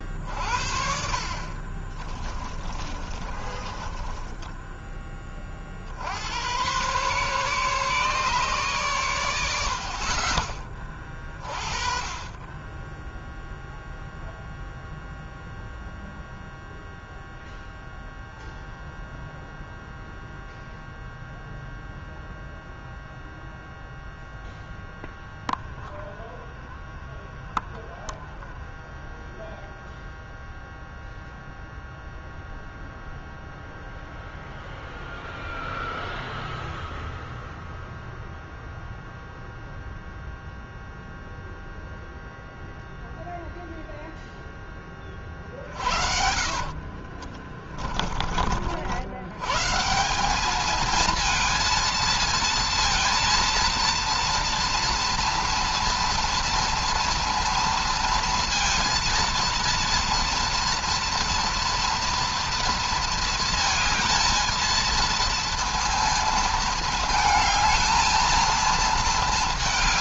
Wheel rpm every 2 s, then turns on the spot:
60, 20, 20, 120, 120, 20, 20, 0, 0, 0, 0, 0, 0, 0, 0, 0, 0, 0, 0, 0, 0, 0, 20, 50, 70, 220, 230, 230, 230, 230, 230, 230, 220, 220, 230.
2-4 46-48